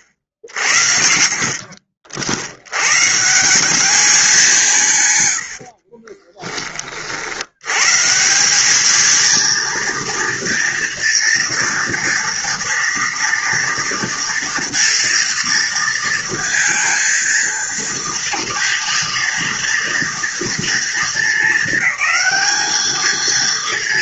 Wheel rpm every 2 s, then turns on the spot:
60, 110, 150, 40, 210, 230, 230, 230, 230, 230, 220, 210.
none